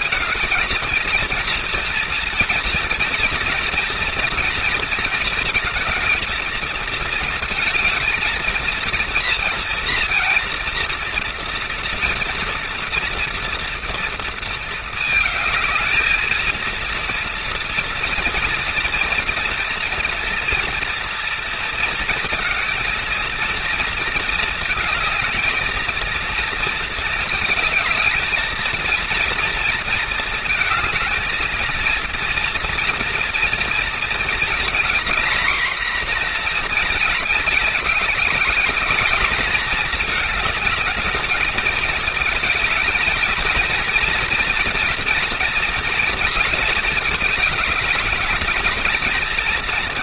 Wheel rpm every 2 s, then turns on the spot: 230, 240, 230, 230, 220, 230, 230, 230, 230, 230, 230, 230, 220, 220, 230, 230, 230, 230, 240, 210, 220, 220, 240, 230, 220.
none